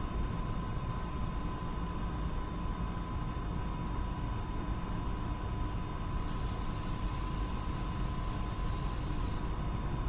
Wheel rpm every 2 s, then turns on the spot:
0, 0, 0, 0, 0.
none